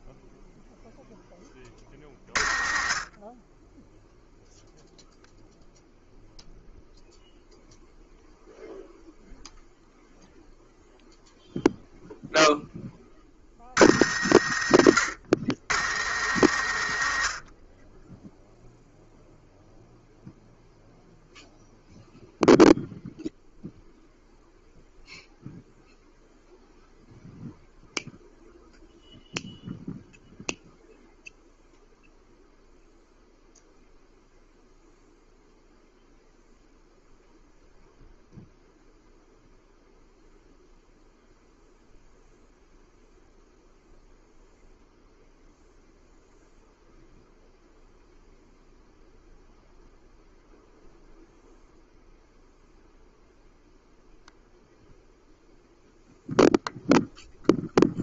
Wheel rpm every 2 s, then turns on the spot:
0, 40, 0, 0, 0, 0, 10, 70, 100, 0, 0, 0, 0, 0, 0, 0, 0, 0, 0, 0, 0, 0, 0, 0, 0, 0, 0, 0, 0.
none